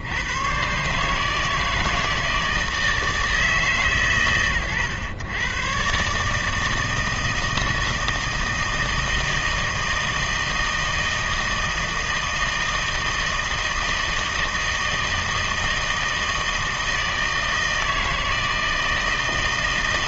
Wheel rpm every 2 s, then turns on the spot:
120, 160, 110, 160, 160, 160, 160, 160, 160, 160.
none